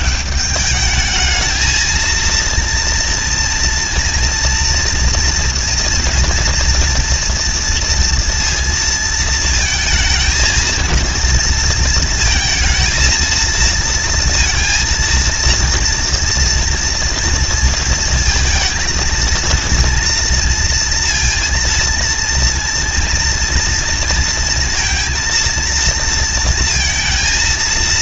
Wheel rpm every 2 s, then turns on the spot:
210, 230, 230, 230, 230, 230, 230, 230, 230, 230, 230, 230, 230, 230.
none